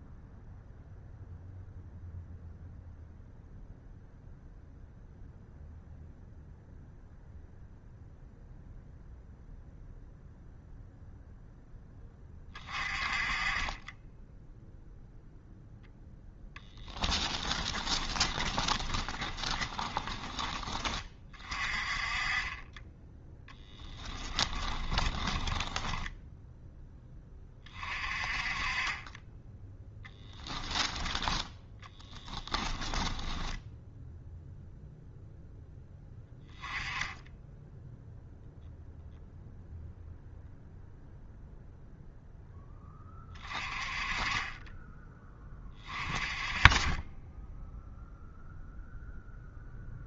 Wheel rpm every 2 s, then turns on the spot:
0, 0, 0, 0, 0, 0, 30, 0, 20, 20, 20, 10, 20, 10, 20, 10, 10, 0, 10, 0, 0, 10, 20, 20, 0.
16-20 24-26 32-34